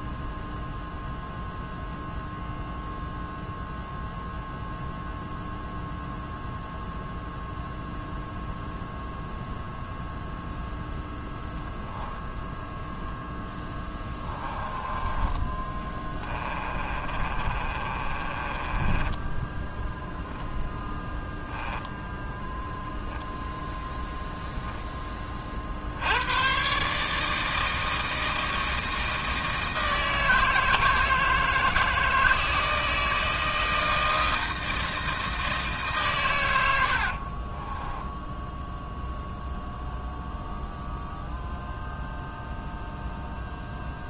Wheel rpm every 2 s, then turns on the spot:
0, 0, 0, 0, 0, 0, 0, 10, 30, 10, 0, 0, 10, 130, 160, 160, 160, 160, 100, 0, 0, 0.
14-20